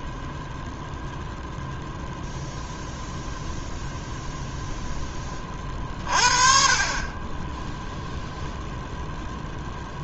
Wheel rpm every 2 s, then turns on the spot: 0, 0, 0, 30, 0.
none